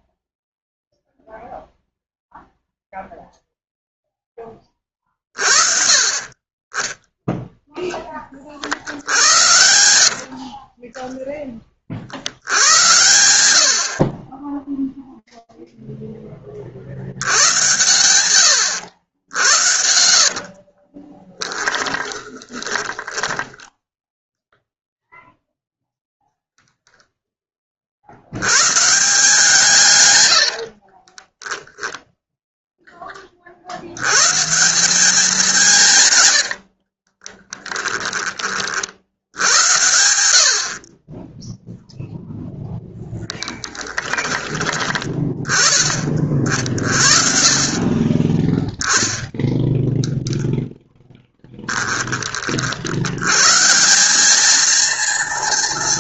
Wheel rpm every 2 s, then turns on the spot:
0, 0, 10, 30, 30, 60, 70, 40, 30, 100, 50, 20, 0, 0, 140, 40, 10, 170, 70, 40, 60, 0, 20, 40, 10, 0, 50, 210.
10-12 20-24 30-32 36-38 40-42